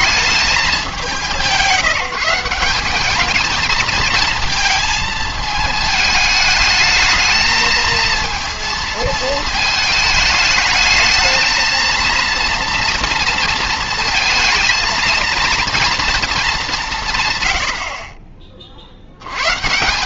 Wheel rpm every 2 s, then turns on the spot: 210, 180, 220, 210, 220, 210, 230, 230, 200, 40.
none